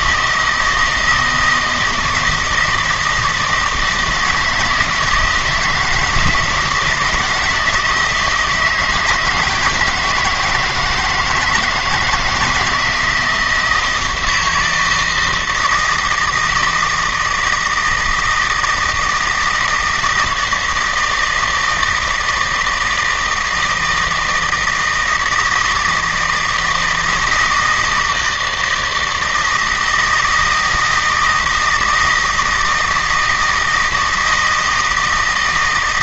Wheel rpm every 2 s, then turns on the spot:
160, 160, 160, 160, 160, 160, 170, 160, 160, 160, 160, 160, 160, 160, 160, 160, 160, 160.
none